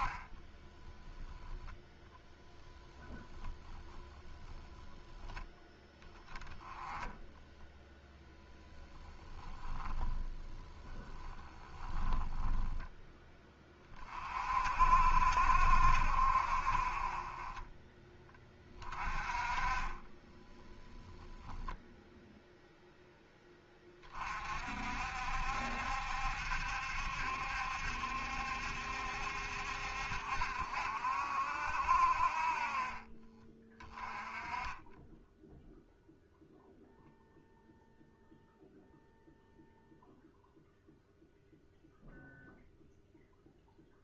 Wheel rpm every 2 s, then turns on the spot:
10, 0, 0, 20, 10, 20, 10, 60, 50, 20, 0, 0, 50, 70, 70, 60, 40, 20, 0, 0, 0, 0.
0-2 10-12